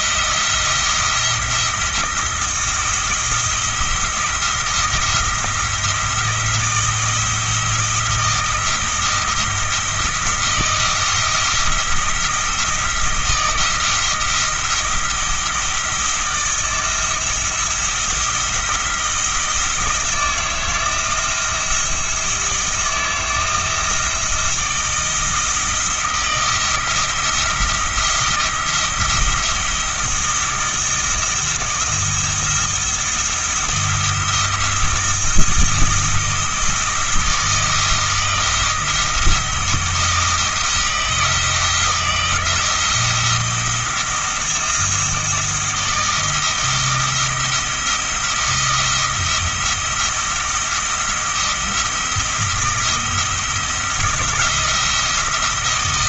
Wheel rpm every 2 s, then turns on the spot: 170, 170, 170, 170, 160, 170, 160, 170, 170, 160, 170, 170, 160, 170, 170, 160, 170, 170, 170, 170, 160, 170, 160, 170, 170, 170, 170, 170.
none